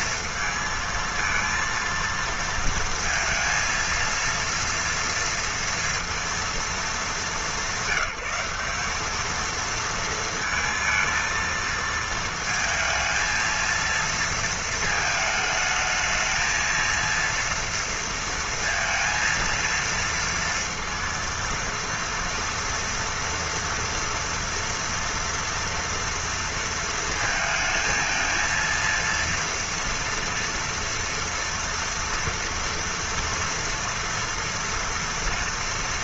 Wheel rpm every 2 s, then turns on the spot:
230, 230, 230, 220, 200, 230, 220, 220, 230, 230, 230, 230, 230, 230, 230, 230, 230, 230.
none